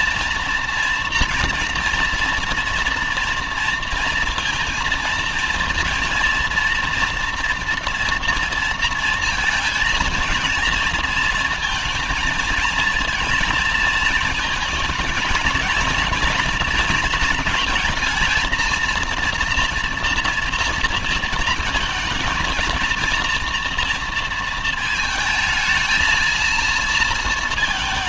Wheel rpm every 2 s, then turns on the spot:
230, 230, 230, 230, 230, 230, 230, 220, 220, 230, 230, 230, 230, 230.
none